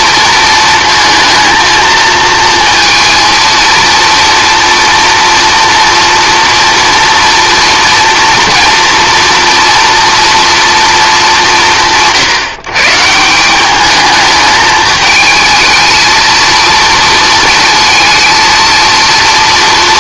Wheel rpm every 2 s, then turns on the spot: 230, 230, 230, 230, 230, 230, 150, 220, 230, 230.
none